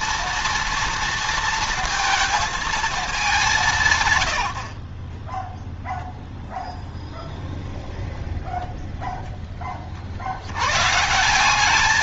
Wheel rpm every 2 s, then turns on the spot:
230, 230, 90, 0, 0, 90.
none